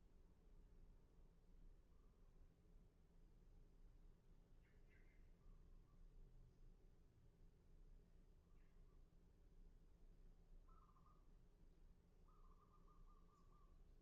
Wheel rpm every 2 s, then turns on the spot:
0, 0, 0, 0, 0, 0, 0.
none